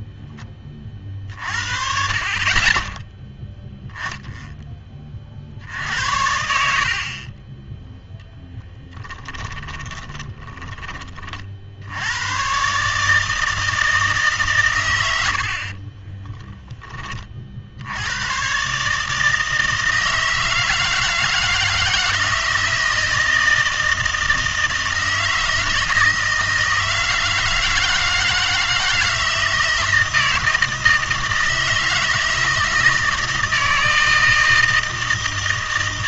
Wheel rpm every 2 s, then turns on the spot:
20, 20, 10, 70, 10, 20, 130, 130, 10, 130, 160, 160, 160, 160, 160, 160, 170, 160.
8-10